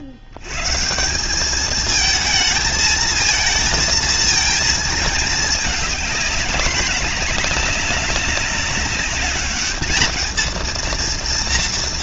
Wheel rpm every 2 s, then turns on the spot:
140, 220, 220, 210, 210, 230.
none